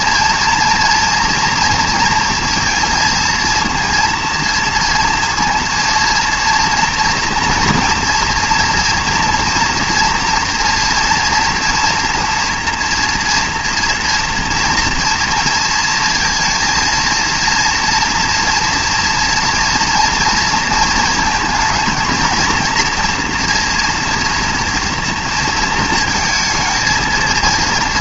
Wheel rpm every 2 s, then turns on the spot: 230, 230, 230, 230, 230, 230, 240, 230, 230, 230, 230, 230, 230, 220.
none